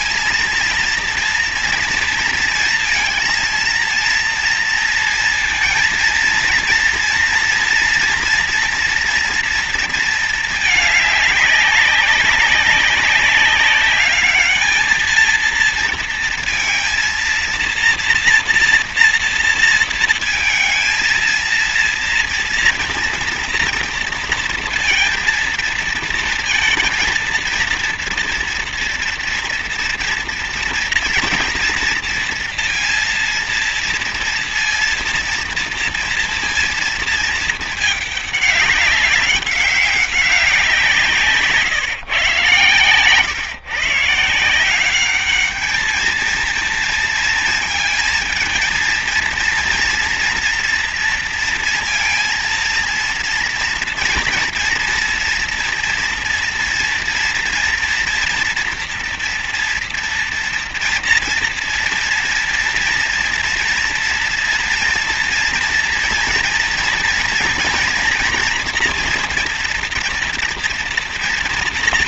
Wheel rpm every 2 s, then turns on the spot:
230, 230, 230, 230, 240, 220, 190, 220, 230, 230, 230, 240, 230, 230, 230, 240, 230, 230, 230, 200, 180, 130, 180, 230, 230, 230, 240, 230, 230, 240, 230, 230, 230, 230, 230, 230.
none